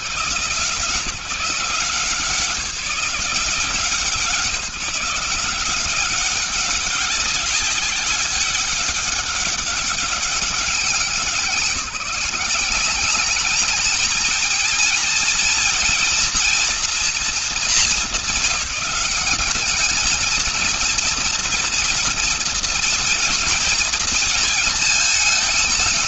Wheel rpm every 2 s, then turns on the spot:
150, 180, 170, 200, 200, 180, 210, 220, 230, 200, 230, 220, 220.
none